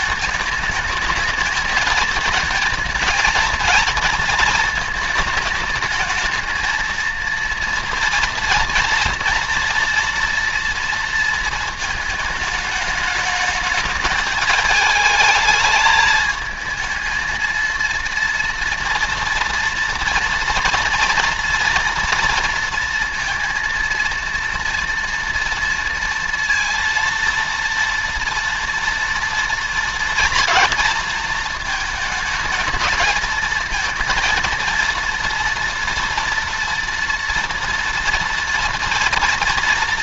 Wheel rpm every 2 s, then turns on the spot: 220, 220, 230, 220, 230, 230, 220, 210, 220, 230, 230, 230, 230, 230, 230, 230, 220, 230, 230, 230.
none